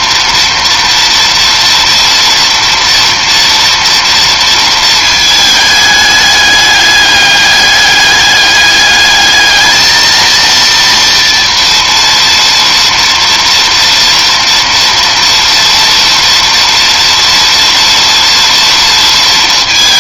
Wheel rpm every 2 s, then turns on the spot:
230, 230, 230, 210, 200, 230, 230, 230, 230, 230.
none